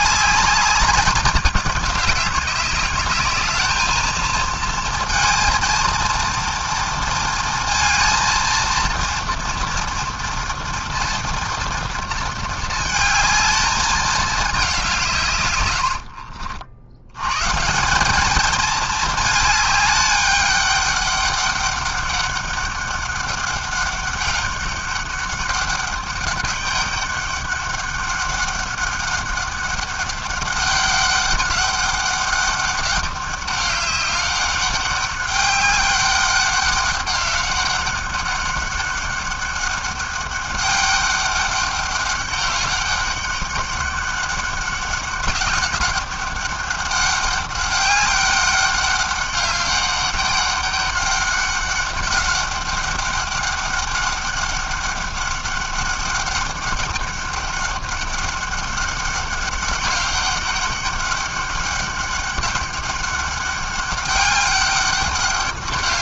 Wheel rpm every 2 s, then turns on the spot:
200, 210, 230, 230, 230, 230, 220, 140, 120, 210, 200, 200, 200, 200, 200, 200, 200, 200, 190, 200, 200, 200, 200, 200, 200, 200, 200, 200, 200, 200, 200, 200, 200.
none